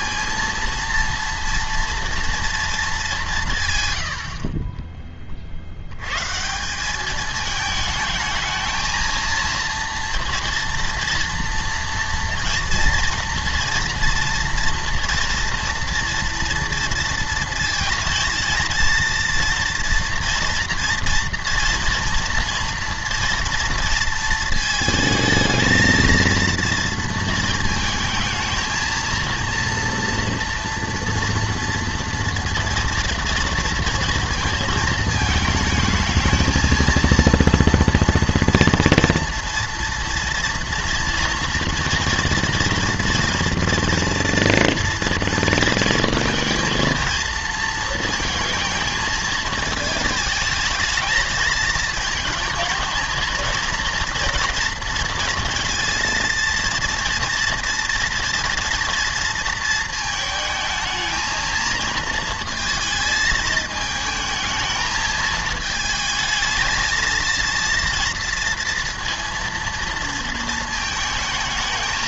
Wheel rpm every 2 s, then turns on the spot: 230, 230, 30, 170, 220, 230, 230, 230, 230, 230, 240, 230, 220, 230, 230, 230, 230, 220, 230, 230, 230, 230, 230, 230, 230, 220, 230, 240, 230, 230, 220, 220, 220, 220, 230, 230.
none